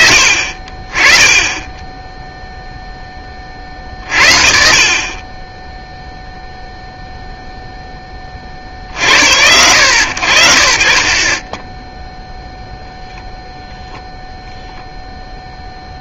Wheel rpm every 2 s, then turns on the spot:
20, 20, 40, 0, 60, 50, 0, 0.
none